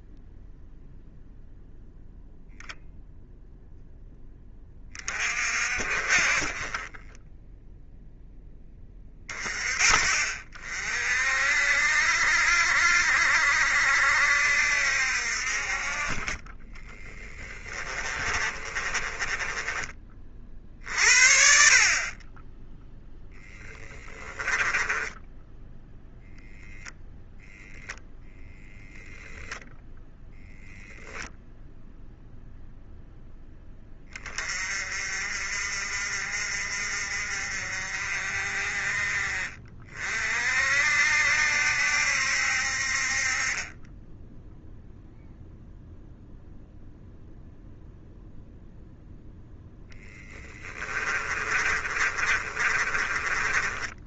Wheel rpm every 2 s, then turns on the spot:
0, 0, 30, 20, 20, 40, 60, 60, 20, 30, 50, 10, 10, 0, 0, 10, 0, 30, 50, 40, 50, 60, 0, 0, 0, 20, 30.
16-20 22-26 50-54